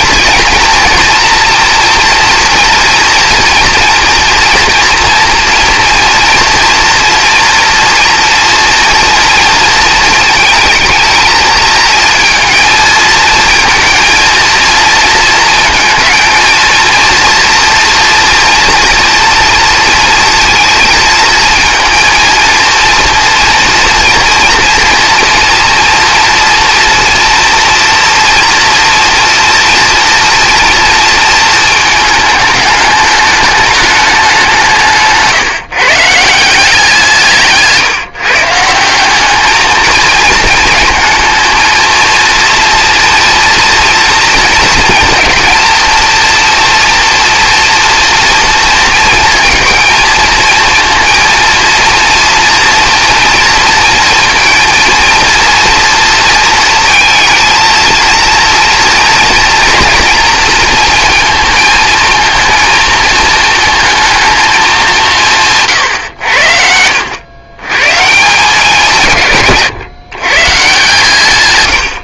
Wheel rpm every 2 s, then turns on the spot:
230, 230, 230, 230, 230, 220, 220, 230, 230, 230, 230, 230, 230, 230, 230, 230, 210, 180, 180, 170, 230, 230, 230, 240, 230, 230, 230, 230, 230, 230, 220, 220, 200, 80, 160, 150.
34-36